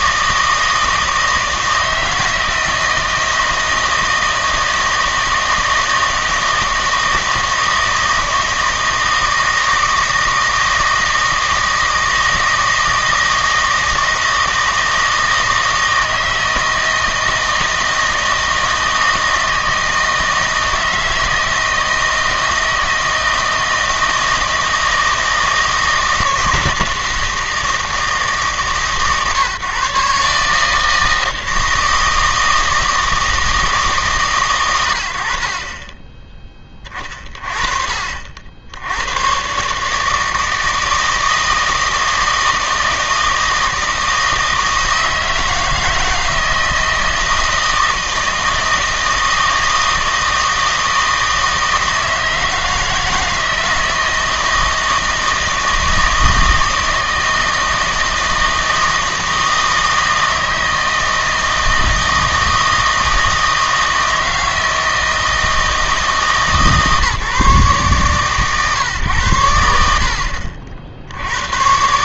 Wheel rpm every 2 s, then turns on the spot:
160, 160, 160, 160, 160, 160, 160, 160, 160, 160, 160, 160, 160, 160, 140, 150, 160, 90, 20, 90, 160, 160, 160, 160, 160, 160, 160, 160, 160, 160, 160, 160, 160, 150, 130, 60.
none